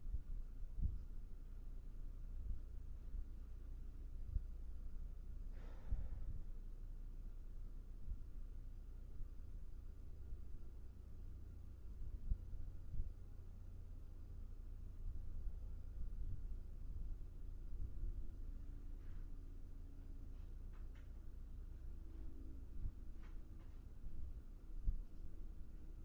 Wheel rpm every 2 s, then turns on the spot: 0, 0, 0, 0, 0, 0, 0, 0, 0, 0, 0, 0, 0.
none